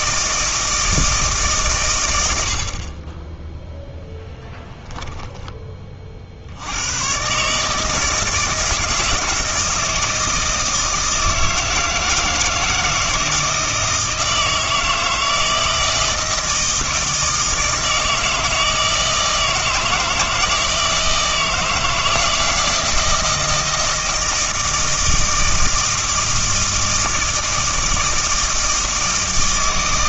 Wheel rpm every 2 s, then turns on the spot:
160, 50, 10, 80, 160, 160, 160, 160, 160, 160, 160, 160, 160, 160, 160.
4-6